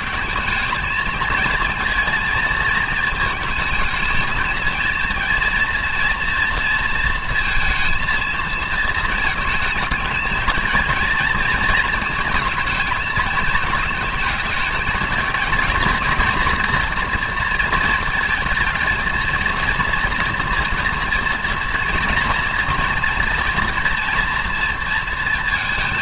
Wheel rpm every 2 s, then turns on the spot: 210, 220, 220, 230, 230, 230, 230, 220, 230, 220, 230, 230, 230.
none